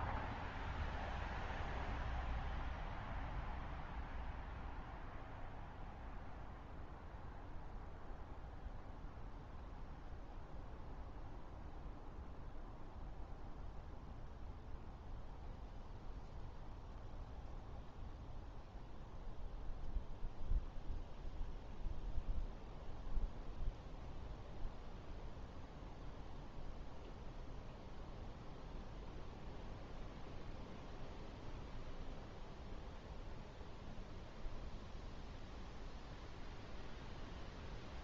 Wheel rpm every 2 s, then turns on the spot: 0, 0, 0, 0, 0, 0, 0, 0, 0, 0, 0, 0, 0, 0, 0, 0, 0, 0, 0.
none